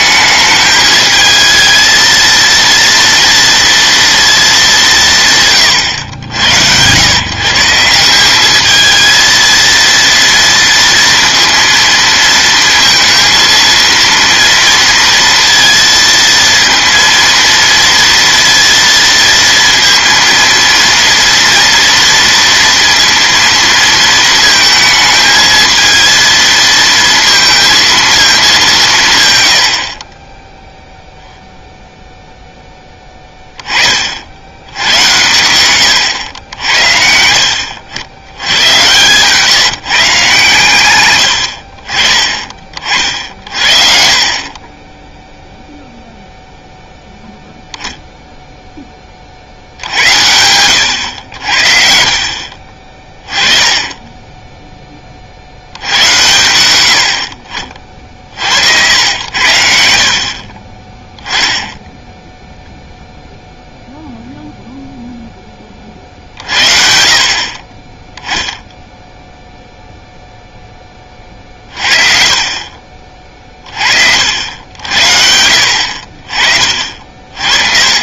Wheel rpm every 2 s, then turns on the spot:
220, 230, 210, 100, 220, 230, 230, 230, 230, 230, 230, 230, 220, 230, 180, 0, 10, 90, 80, 110, 130, 40, 20, 0, 10, 100, 30, 10, 90, 70, 30, 0, 0, 50, 0, 20, 40, 70, 40.
42-46